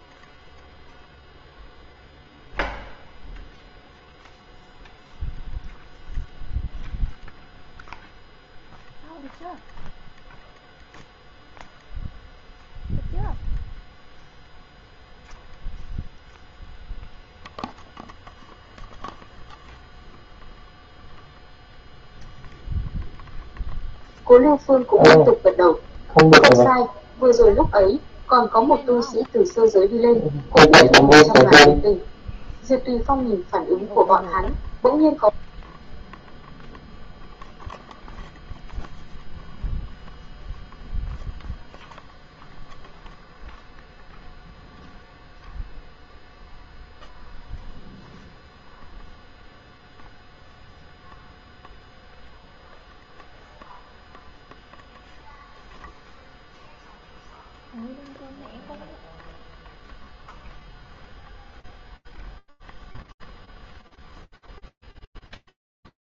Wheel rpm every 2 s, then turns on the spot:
0, 0, 0, 0, 0, 0, 0, 0, 0, 0, 0, 0, 0, 0, 0, 0, 0, 0, 0, 0, 0, 0, 0, 0, 0, 0, 0, 0, 0, 0, 0, 0, 0.
none